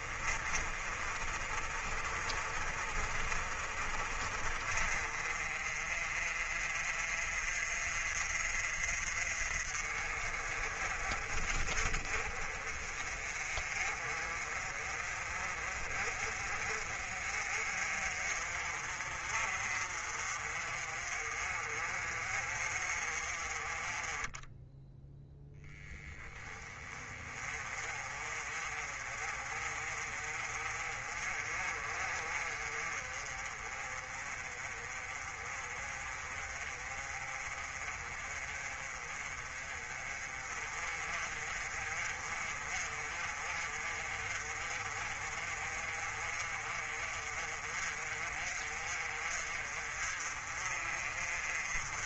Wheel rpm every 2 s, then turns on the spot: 40, 40, 40, 40, 40, 40, 40, 30, 40, 40, 40, 40, 10, 20, 40, 40, 30, 30, 30, 30, 40, 40, 40, 40, 40, 40.
none